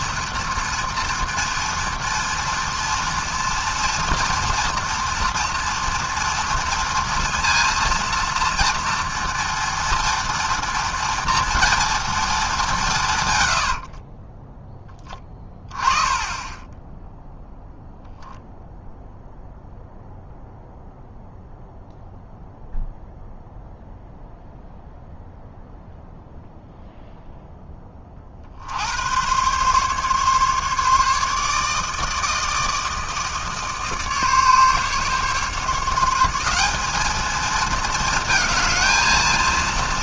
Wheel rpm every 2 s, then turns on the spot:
230, 230, 230, 230, 230, 230, 210, 20, 10, 0, 0, 0, 0, 0, 50, 140, 160, 150, 190, 220.
14-16